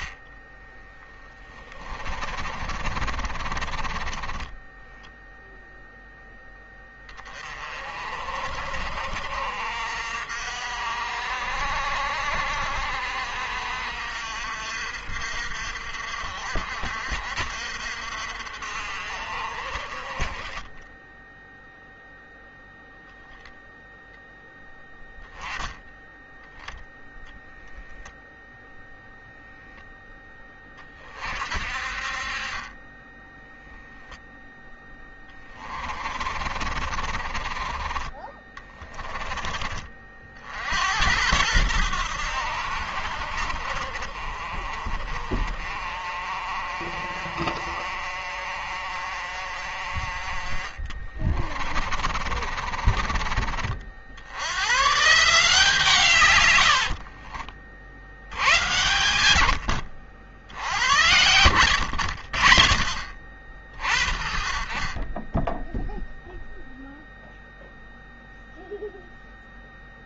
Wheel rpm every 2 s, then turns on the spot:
10, 30, 20, 10, 50, 60, 60, 60, 60, 50, 20, 0, 0, 10, 0, 20, 30, 0, 40, 20, 70, 70, 50, 50, 50, 40, 40, 100, 90, 100, 70, 40, 40, 0, 0.
0-6 36-40 50-54 56-60